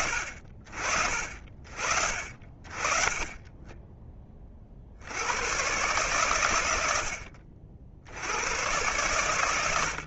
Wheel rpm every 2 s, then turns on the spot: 40, 30, 60, 90, 110.
none